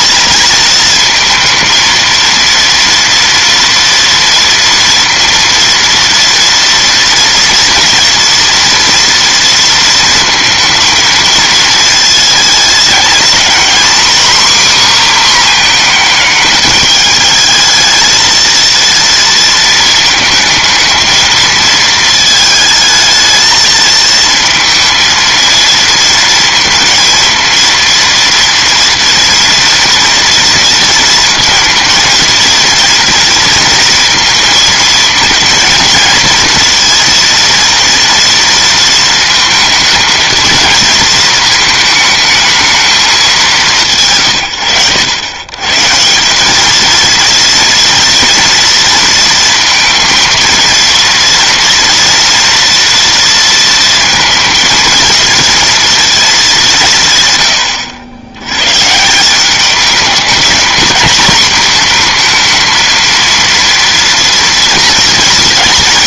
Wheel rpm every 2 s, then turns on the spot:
230, 230, 230, 230, 230, 230, 220, 270, 220, 230, 220, 220, 230, 230, 230, 230, 230, 230, 230, 230, 230, 210, 100, 220, 230, 230, 230, 230, 170, 120, 220, 230, 230.
none